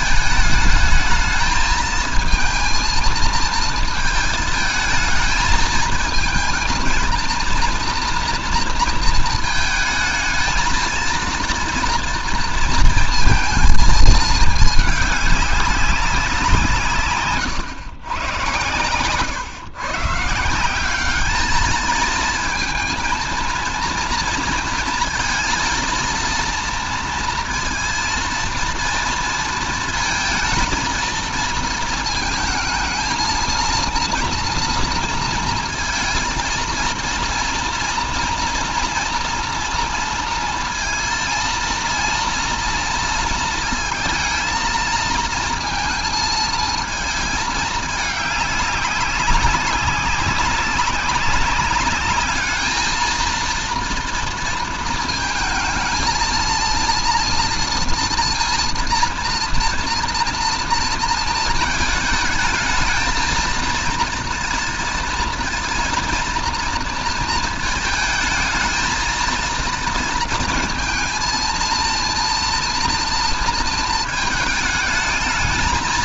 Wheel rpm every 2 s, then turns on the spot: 210, 220, 220, 220, 230, 230, 230, 220, 160, 110, 180, 220, 230, 230, 230, 230, 220, 230, 230, 240, 230, 230, 220, 220, 200, 190, 220, 230, 230, 230, 230, 220, 230, 230, 220, 230, 230, 220.
none